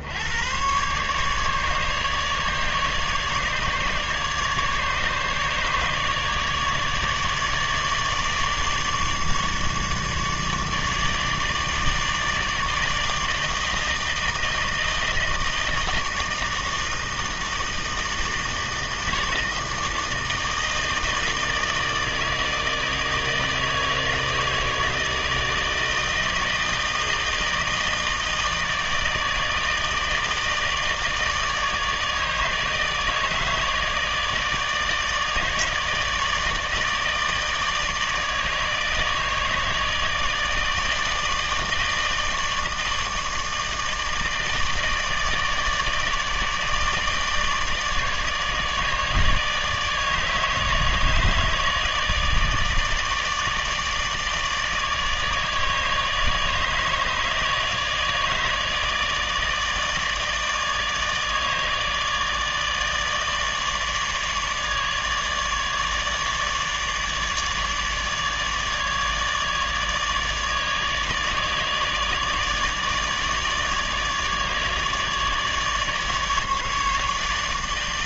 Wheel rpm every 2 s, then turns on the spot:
120, 150, 150, 150, 150, 150, 160, 160, 160, 160, 160, 160, 160, 160, 160, 160, 150, 150, 150, 160, 160, 160, 160, 150, 150, 160, 160, 150, 160, 150, 150, 150, 150, 150, 150, 150, 150, 150, 150.
none